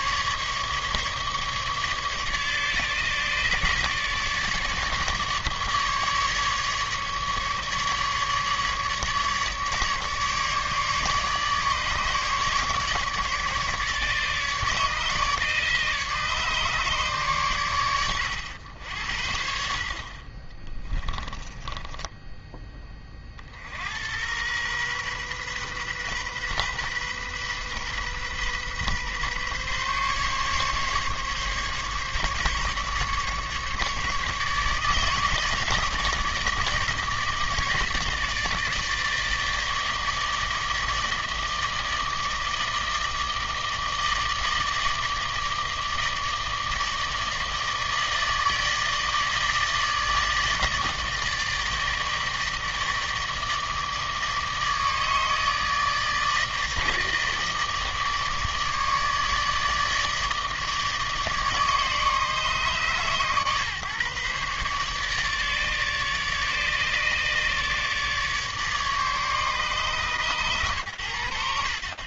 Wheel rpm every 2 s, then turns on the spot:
150, 150, 150, 150, 150, 150, 150, 150, 150, 90, 20, 20, 120, 130, 130, 140, 140, 150, 150, 150, 160, 160, 160, 150, 150, 160, 160, 150, 150, 150, 150, 150, 140, 150, 150, 120.
20-22